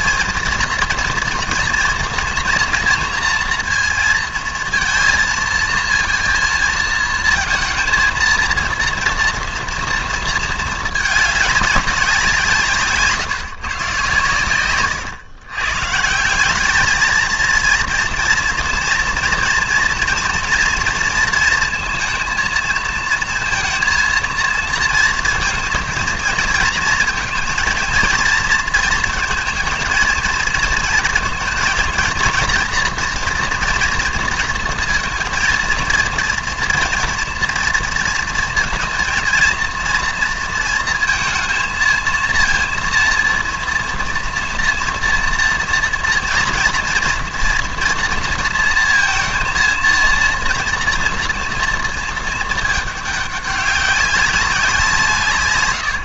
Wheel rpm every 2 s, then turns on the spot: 230, 240, 230, 230, 230, 220, 160, 120, 200, 240, 230, 220, 230, 230, 220, 220, 230, 230, 230, 230, 230, 230, 240, 230, 230, 230, 220, 190.
none